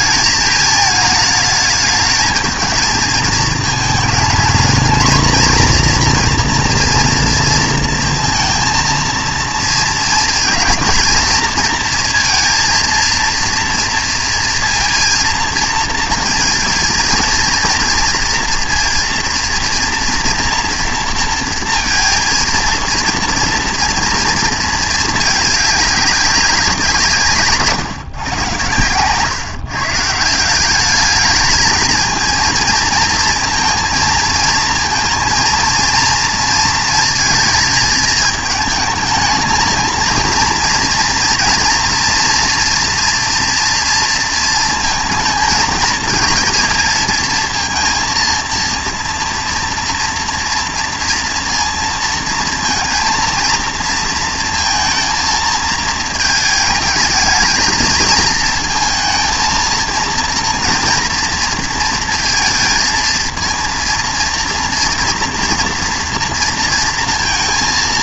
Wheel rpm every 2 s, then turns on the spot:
220, 220, 220, 230, 230, 230, 230, 230, 230, 230, 230, 230, 220, 180, 120, 180, 230, 230, 230, 220, 230, 240, 230, 220, 230, 230, 230, 230, 220, 230, 230, 230, 230, 230.
none